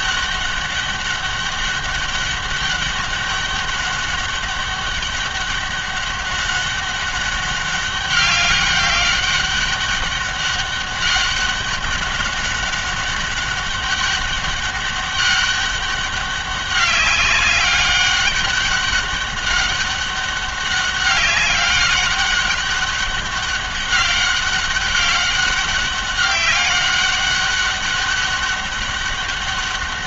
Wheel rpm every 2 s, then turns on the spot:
200, 200, 200, 200, 200, 200, 200, 200, 200, 200, 190, 200, 200, 200, 200.
none